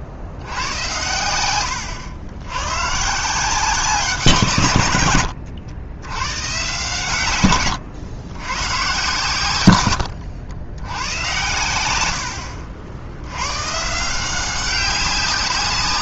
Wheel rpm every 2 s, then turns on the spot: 70, 100, 150, 130, 120, 90, 70, 180.
none